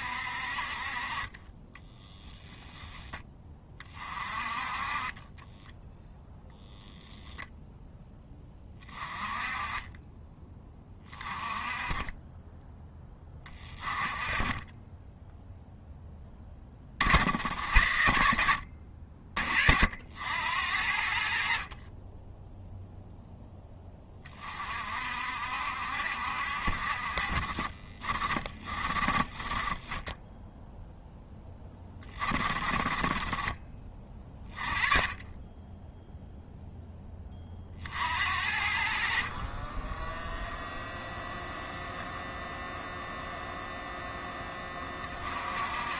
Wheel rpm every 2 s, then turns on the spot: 50, 10, 30, 0, 20, 30, 10, 20, 40, 60, 80, 0, 40, 50, 30, 0, 30, 20, 0, 60, 0, 0, 20.
4-6